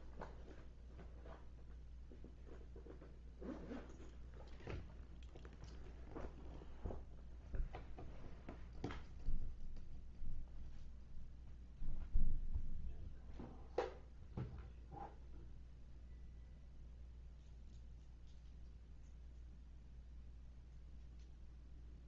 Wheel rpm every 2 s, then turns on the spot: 0, 0, 0, 0, 0, 0, 0, 0, 0, 0, 0.
none